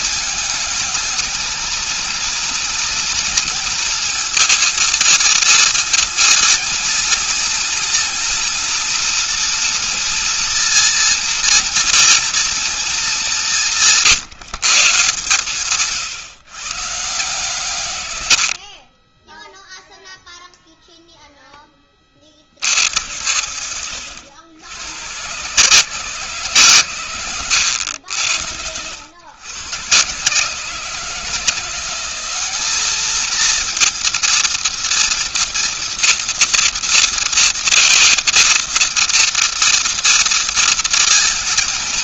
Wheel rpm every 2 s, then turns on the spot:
220, 230, 230, 230, 240, 230, 230, 150, 130, 90, 0, 40, 80, 140, 80, 140, 190, 230, 240, 230, 230.
18-20